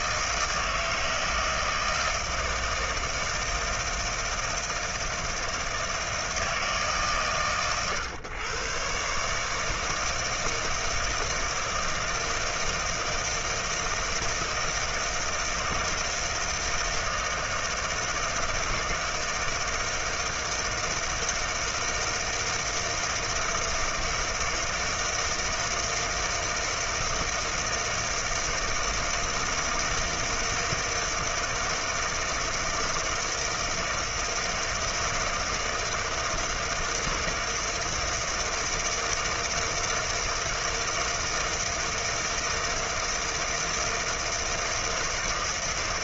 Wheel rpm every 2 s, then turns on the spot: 160, 160, 160, 140, 120, 160, 160, 160, 160, 160, 160, 160, 160, 160, 160, 160, 160, 160, 160, 160, 160, 160, 160.
none